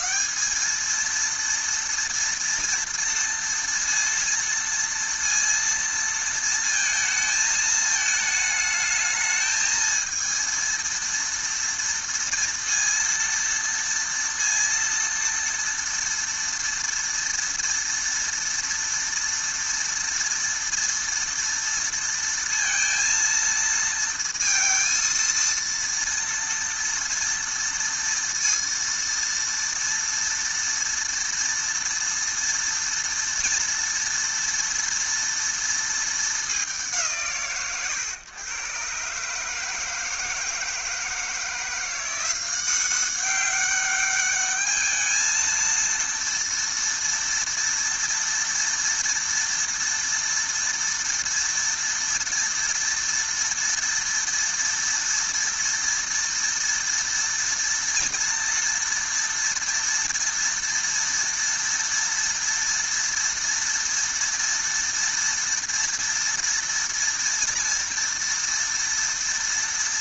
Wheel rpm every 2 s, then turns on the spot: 220, 230, 230, 230, 210, 230, 230, 230, 230, 230, 230, 230, 230, 230, 230, 230, 230, 230, 170, 110, 160, 180, 210, 230, 230, 230, 230, 230, 230, 230, 230, 230, 230, 240, 230.
none